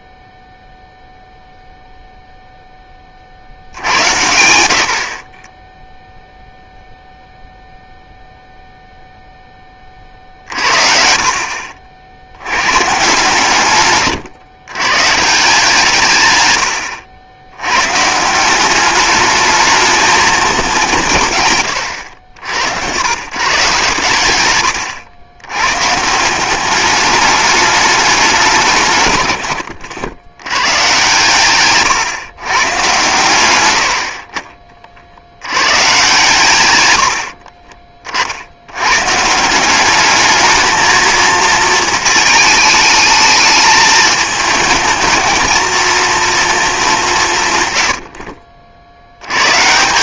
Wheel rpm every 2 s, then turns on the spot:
0, 0, 70, 0, 0, 50, 120, 120, 70, 190, 180, 90, 100, 200, 160, 120, 130, 50, 110, 100, 220, 220, 220, 210, 60.
10-12